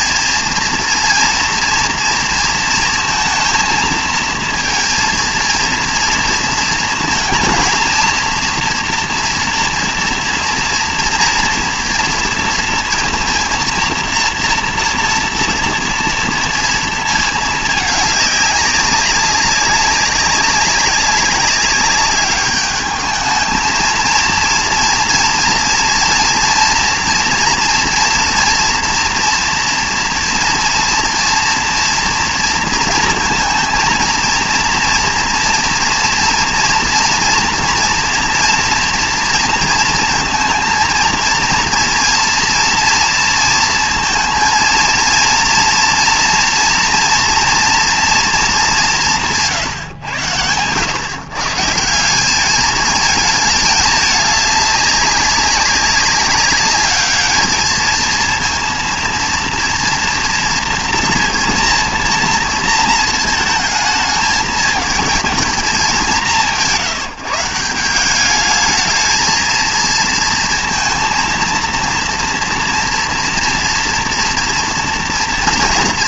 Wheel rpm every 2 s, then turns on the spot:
230, 230, 230, 230, 230, 230, 230, 230, 230, 200, 190, 210, 230, 230, 230, 230, 230, 230, 230, 230, 230, 230, 230, 230, 210, 100, 210, 200, 200, 230, 230, 230, 220, 170, 210, 230, 230, 230.
none